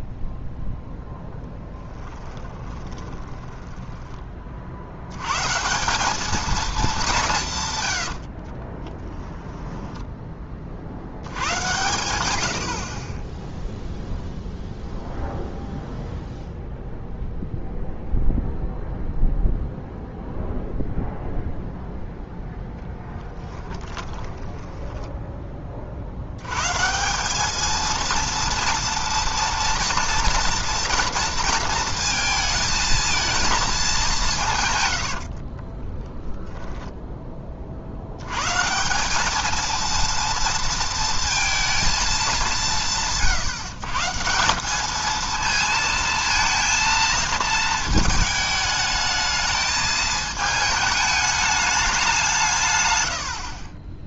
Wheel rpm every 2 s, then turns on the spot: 0, 20, 50, 220, 40, 40, 60, 0, 0, 0, 0, 0, 10, 140, 230, 240, 220, 120, 20, 150, 230, 170, 200, 230, 220, 220, 140.
2-4 8-10 24-26 34-38